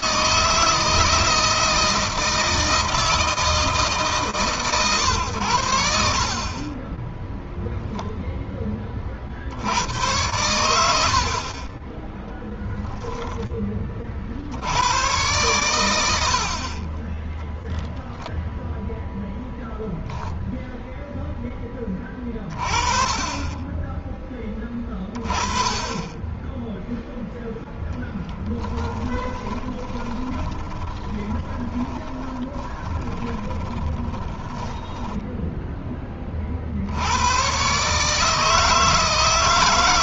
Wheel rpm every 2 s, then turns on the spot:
160, 160, 130, 10, 20, 90, 10, 100, 40, 0, 0, 30, 20, 10, 10, 20, 20, 10, 60, 150.
28-36